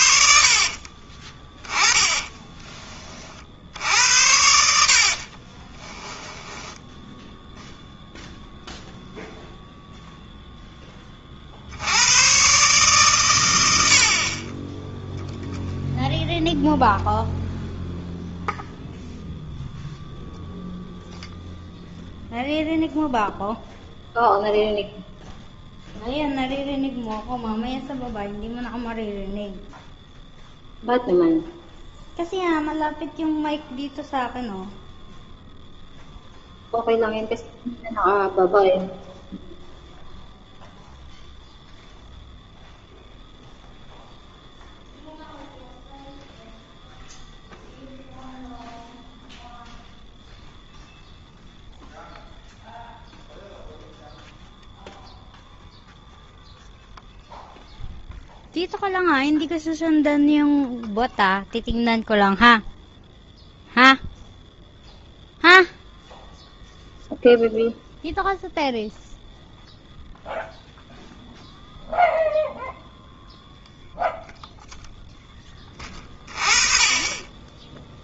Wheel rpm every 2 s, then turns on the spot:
50, 10, 70, 10, 0, 0, 130, 30, 0, 0, 0, 0, 0, 0, 0, 0, 0, 0, 0, 0, 0, 0, 0, 0, 0, 0, 0, 0, 0, 0, 0, 0, 0, 0, 0, 0, 0, 0, 20.
0-2 4-8